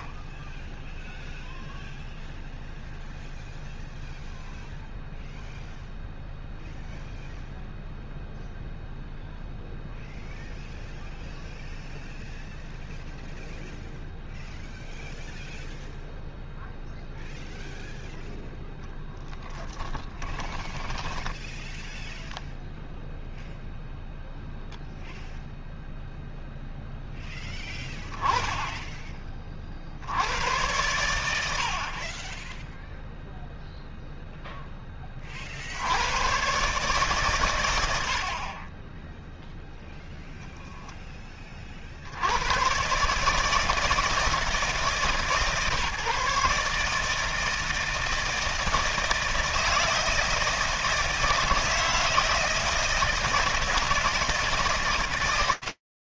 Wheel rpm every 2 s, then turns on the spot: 0, 0, 0, 0, 0, 0, 0, 0, 0, 0, 10, 0, 0, 0, 20, 90, 10, 0, 110, 30, 0, 100, 160, 150, 160, 160, 160, 160.
20-22